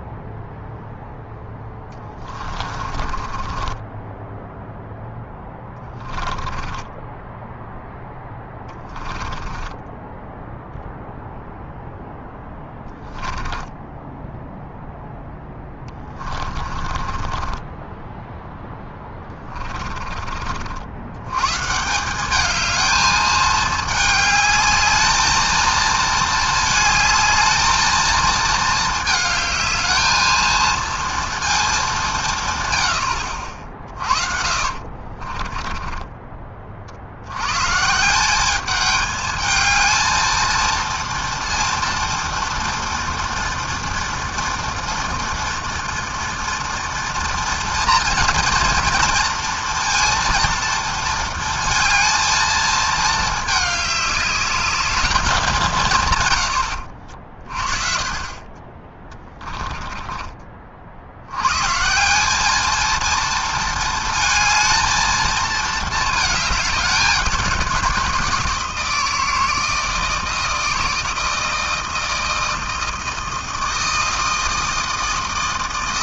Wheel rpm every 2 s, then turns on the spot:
0, 30, 0, 20, 20, 0, 10, 0, 30, 10, 50, 210, 210, 220, 220, 220, 150, 50, 30, 200, 230, 240, 230, 230, 240, 230, 220, 210, 90, 30, 40, 210, 220, 210, 170, 160, 160, 160.
2-4 6-10 16-18 34-36